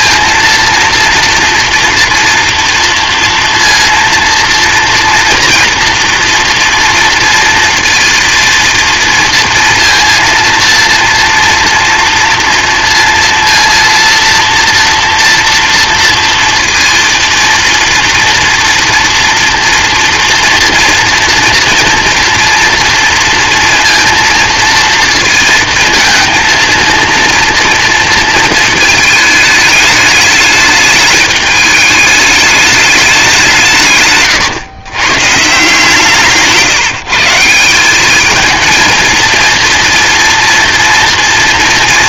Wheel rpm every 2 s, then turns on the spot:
230, 230, 230, 230, 230, 230, 230, 230, 230, 230, 230, 230, 230, 230, 230, 210, 210, 120, 170, 220, 230.
none